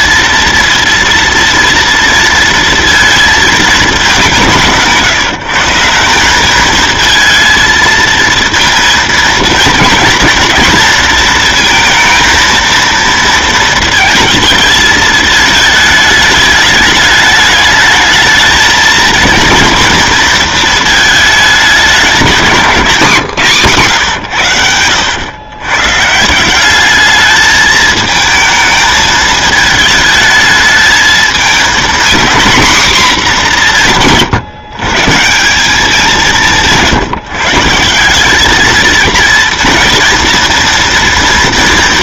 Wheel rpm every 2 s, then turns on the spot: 230, 230, 170, 210, 230, 230, 230, 220, 210, 220, 230, 190, 100, 180, 220, 220, 240, 140, 170, 220, 230.
22-24